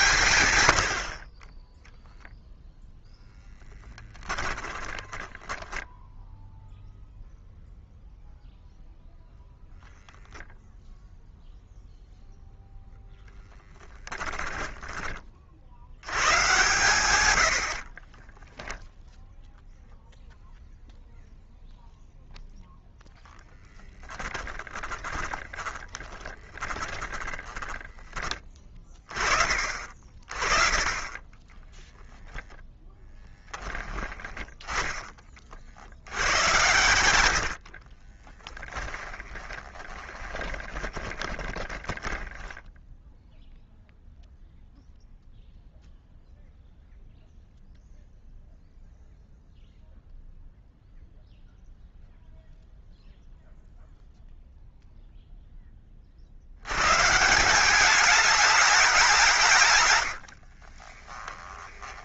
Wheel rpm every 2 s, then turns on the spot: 100, 0, 10, 0, 0, 0, 0, 10, 120, 10, 0, 0, 10, 20, 30, 30, 10, 20, 100, 20, 20, 10, 0, 0, 0, 0, 0, 0, 100, 200, 60.
4-6 24-28 32-34 36-42 60-62